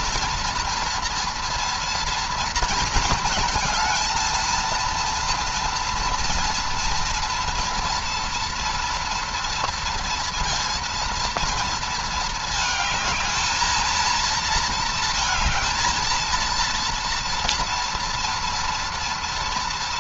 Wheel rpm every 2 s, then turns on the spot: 230, 220, 230, 230, 230, 230, 220, 230, 230, 230.
none